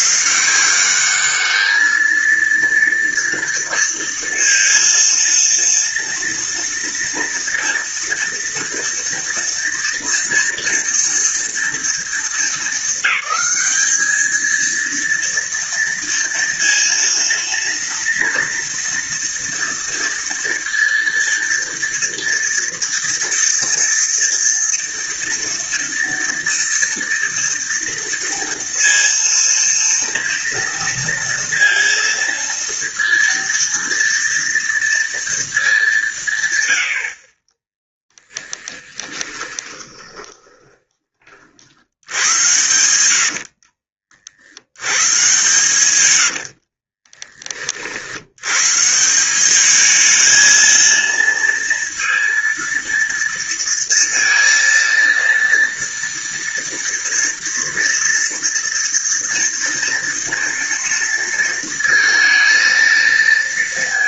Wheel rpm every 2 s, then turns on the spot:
170, 220, 230, 230, 230, 230, 220, 220, 230, 230, 230, 230, 230, 230, 230, 230, 230, 230, 150, 10, 20, 90, 50, 90, 90, 220, 230, 230, 230, 230, 230, 230.
38-44 46-48